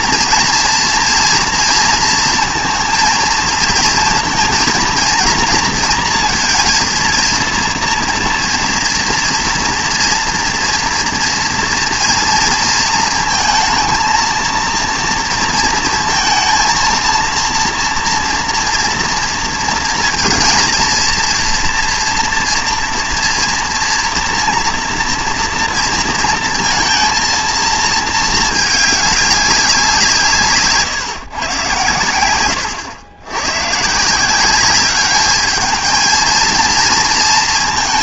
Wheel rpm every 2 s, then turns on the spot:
230, 230, 230, 230, 230, 240, 230, 230, 230, 230, 230, 230, 230, 230, 210, 160, 110, 190, 230.
none